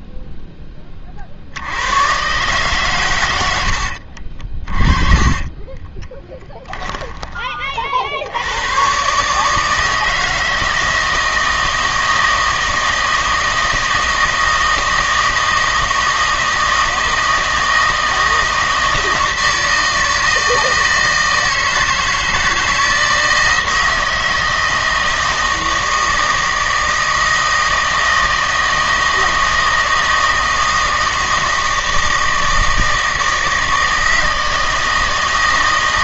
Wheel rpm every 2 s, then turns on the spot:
20, 140, 30, 10, 130, 160, 160, 160, 160, 160, 160, 160, 160, 160, 160, 160, 160, 160.
4-8